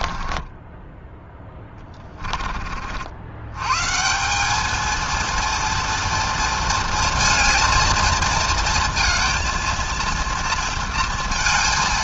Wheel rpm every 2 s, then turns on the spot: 10, 50, 220, 230, 230, 230.
0-2